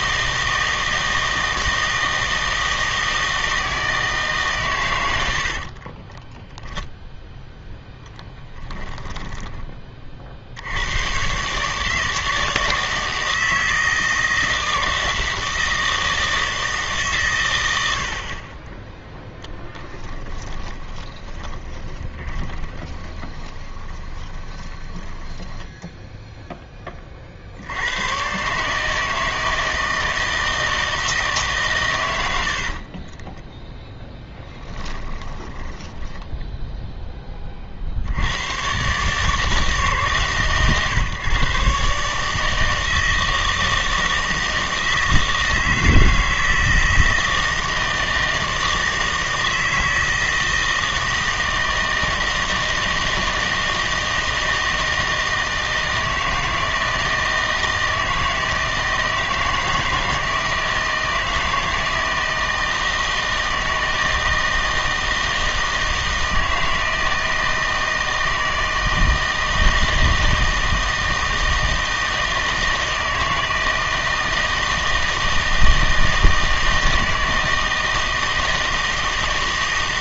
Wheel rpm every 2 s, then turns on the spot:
160, 160, 130, 10, 10, 90, 160, 160, 160, 20, 30, 20, 20, 0, 140, 160, 40, 10, 0, 120, 130, 160, 160, 160, 160, 160, 160, 160, 160, 160, 160, 160, 160, 160, 160, 160, 160, 160, 160, 160.
8-10 20-26 34-36